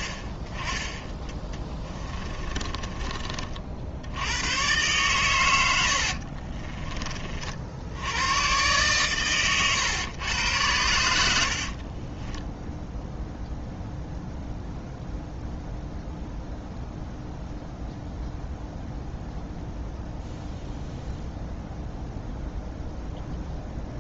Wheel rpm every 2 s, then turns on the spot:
20, 20, 110, 30, 120, 100, 0, 0, 0, 0, 0, 0.
2-4 6-8